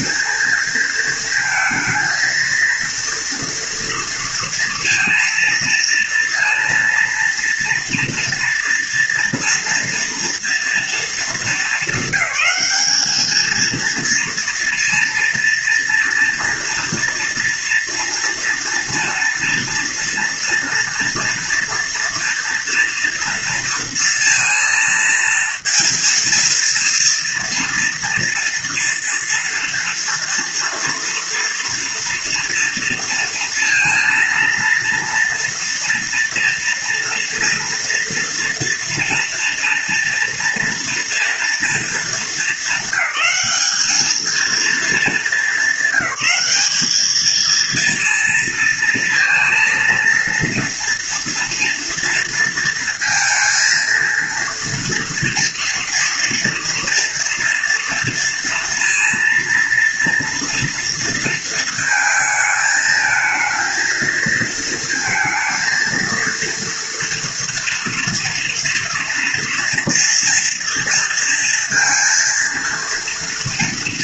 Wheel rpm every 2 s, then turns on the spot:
230, 230, 230, 230, 230, 230, 200, 230, 230, 230, 230, 230, 230, 230, 230, 230, 240, 230, 230, 240, 230, 210, 220, 200, 230, 230, 230, 230, 240, 230, 230, 220, 230, 240, 230, 230, 230.
none